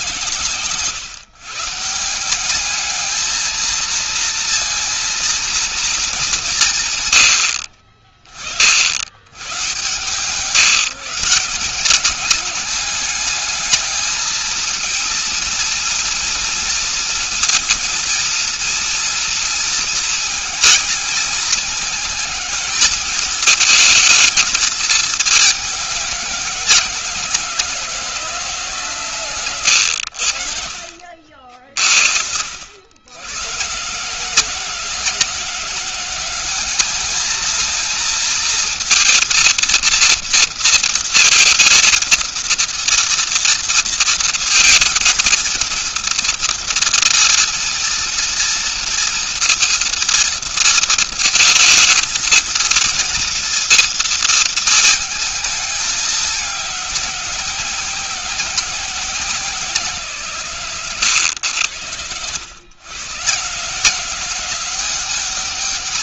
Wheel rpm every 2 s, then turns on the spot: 130, 210, 230, 150, 70, 150, 210, 230, 230, 230, 220, 220, 220, 180, 150, 60, 70, 170, 200, 230, 230, 230, 230, 230, 230, 230, 230, 220, 200, 190, 140, 110, 180.
none